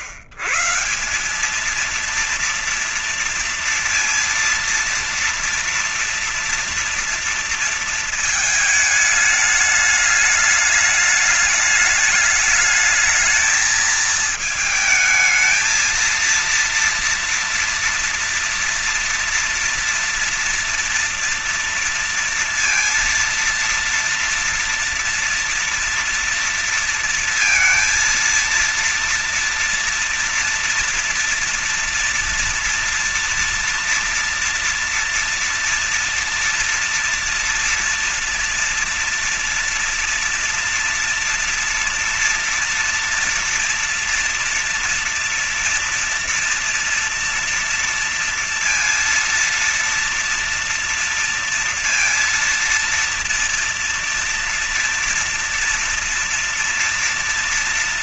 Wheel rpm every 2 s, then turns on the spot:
130, 230, 230, 240, 220, 210, 210, 220, 230, 230, 230, 230, 230, 230, 230, 230, 230, 230, 230, 230, 230, 230, 230, 240, 230, 230, 230, 230, 230.
none